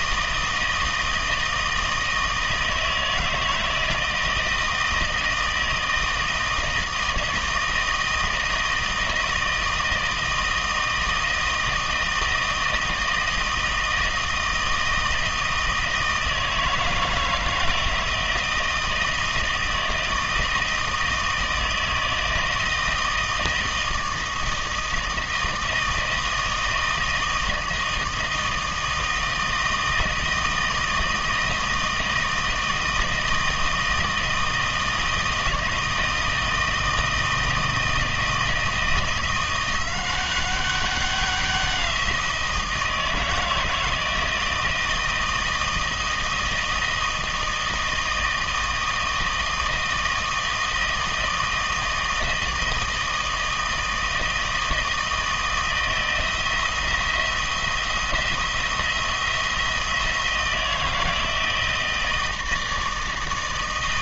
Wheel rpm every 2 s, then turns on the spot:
160, 160, 160, 160, 160, 160, 160, 160, 160, 160, 160, 160, 160, 160, 160, 160, 160, 160, 160, 160, 190, 160, 160, 160, 160, 160, 160, 160, 170, 170, 160, 160.
none